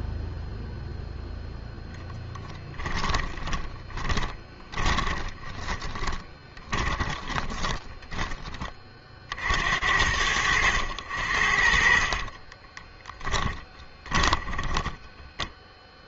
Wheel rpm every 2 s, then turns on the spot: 0, 30, 20, 10, 80, 50, 10, 0.
2-8 10-14